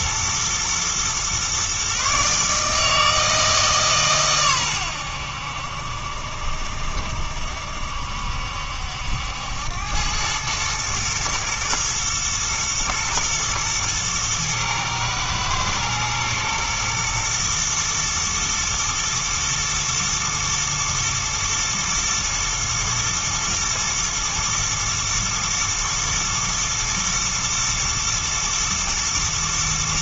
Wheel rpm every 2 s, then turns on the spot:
120, 150, 110, 70, 70, 110, 120, 110, 110, 120, 120, 110, 110, 110, 120.
none